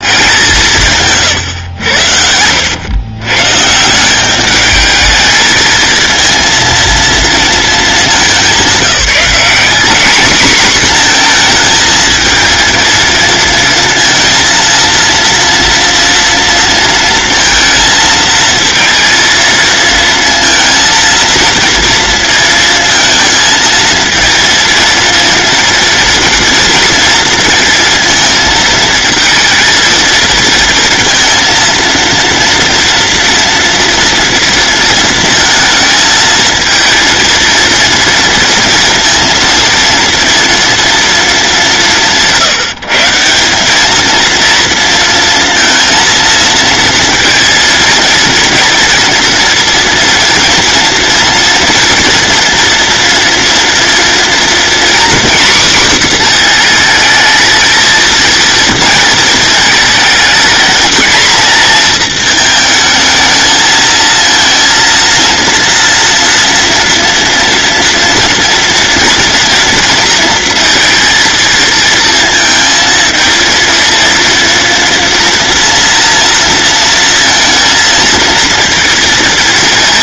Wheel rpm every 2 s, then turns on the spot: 170, 100, 210, 230, 190, 240, 230, 230, 230, 230, 230, 220, 230, 230, 220, 230, 230, 230, 230, 230, 230, 160, 230, 230, 230, 230, 240, 250, 230, 230, 220, 220, 230, 230, 240, 230, 230, 230, 230, 230.
none